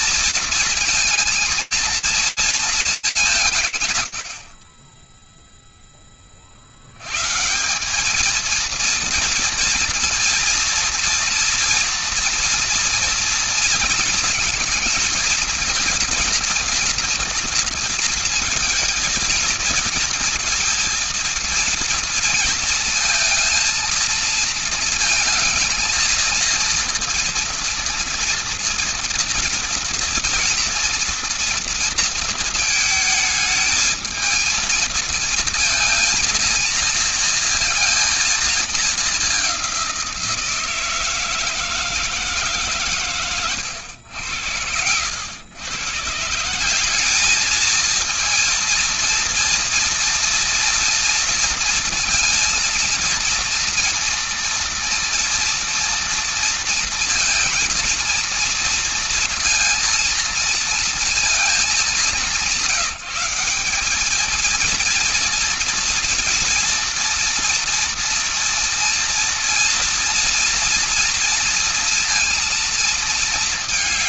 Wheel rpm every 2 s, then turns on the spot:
230, 220, 40, 70, 230, 230, 230, 230, 230, 220, 230, 230, 230, 230, 230, 230, 220, 220, 230, 210, 160, 120, 100, 210, 230, 230, 230, 230, 230, 230, 220, 170, 230, 230, 230, 230, 220.
none